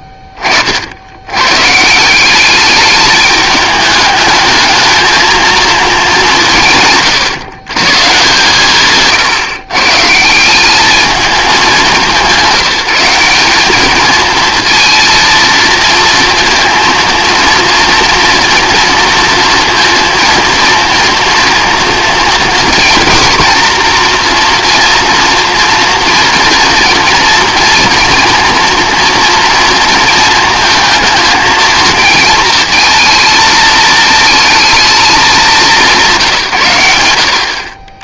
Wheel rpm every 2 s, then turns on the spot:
30, 200, 220, 170, 150, 180, 190, 230, 230, 230, 230, 230, 240, 230, 230, 220, 230, 220, 120.
none